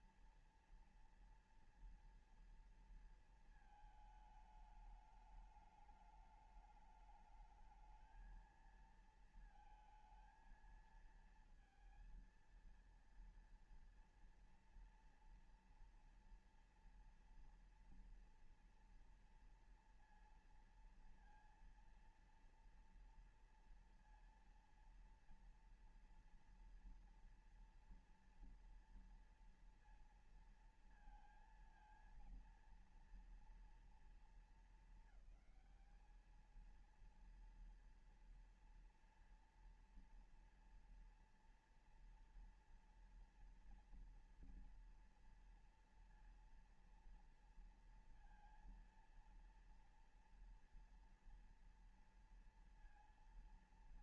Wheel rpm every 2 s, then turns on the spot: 230, 230, 220, 210, 230, 220, 230, 230, 230, 230, 230, 230, 230, 230, 240, 230, 230, 230, 220, 230, 230, 230, 230, 230, 230, 230, 230.
none